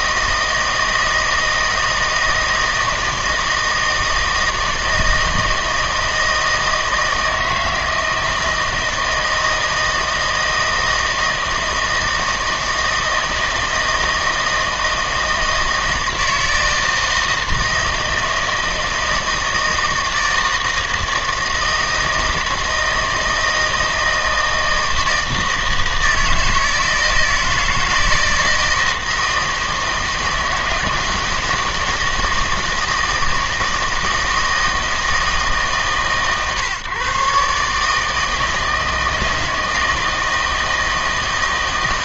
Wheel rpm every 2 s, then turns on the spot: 160, 160, 160, 160, 160, 160, 160, 160, 160, 160, 160, 160, 160, 160, 160, 160, 160, 160, 130, 160, 160.
none